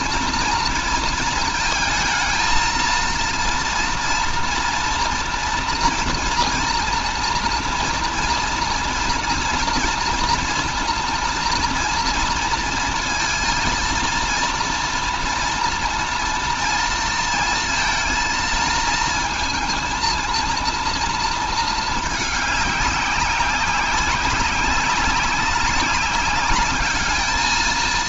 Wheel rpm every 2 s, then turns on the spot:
240, 230, 230, 230, 230, 230, 230, 230, 230, 230, 230, 210, 190, 200.
none